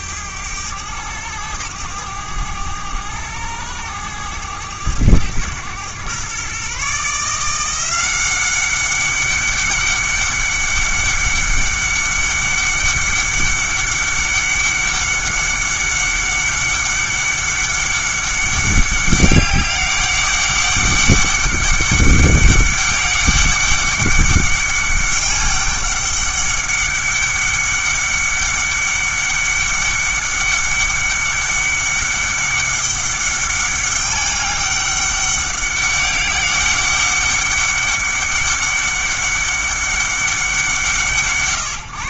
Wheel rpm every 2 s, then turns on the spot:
100, 100, 100, 140, 200, 200, 200, 200, 200, 200, 200, 200, 200, 200, 200, 200, 200, 200, 200, 200, 170.
none